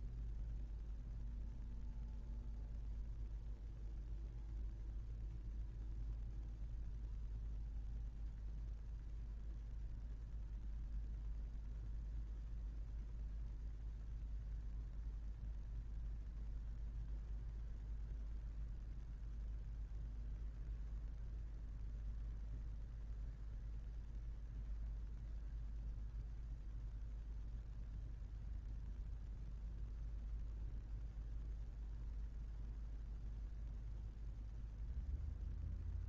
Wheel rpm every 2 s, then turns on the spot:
0, 0, 0, 0, 0, 0, 0, 0, 0, 0, 0, 0, 0, 0, 0, 0, 0, 0.
none